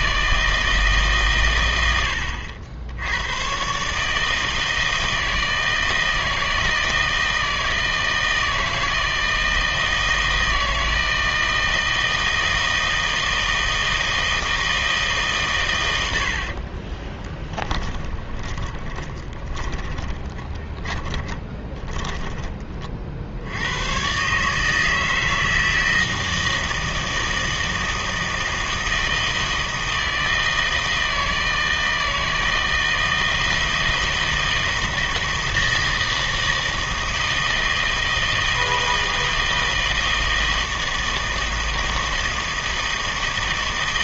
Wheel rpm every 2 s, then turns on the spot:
160, 80, 160, 160, 160, 160, 160, 160, 40, 20, 20, 30, 150, 160, 160, 160, 160, 160, 160, 160, 160, 160.
16-22